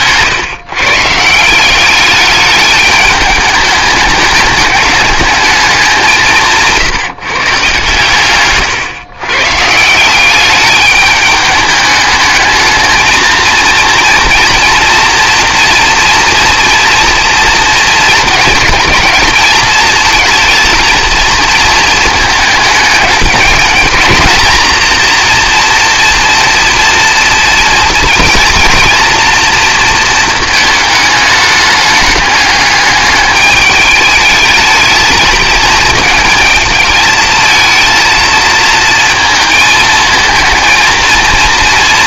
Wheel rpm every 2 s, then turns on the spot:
150, 210, 210, 160, 130, 210, 220, 240, 230, 220, 230, 210, 230, 230, 230, 220, 210, 220, 220, 220, 230.
none